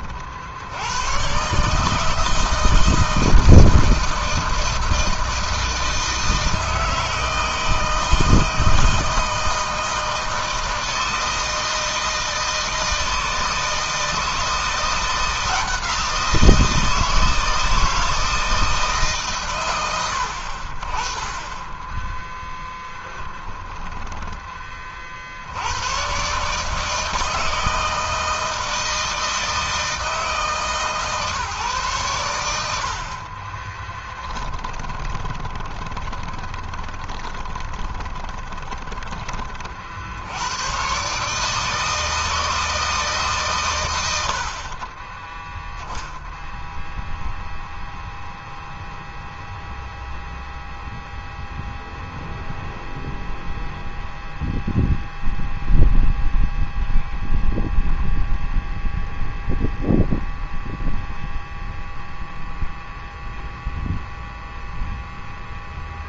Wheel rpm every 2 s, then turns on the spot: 120, 160, 160, 160, 160, 160, 160, 170, 160, 130, 20, 10, 60, 160, 160, 150, 40, 20, 10, 30, 140, 150, 20, 0, 0, 0, 0, 0, 0, 0, 0, 0, 10.
32-38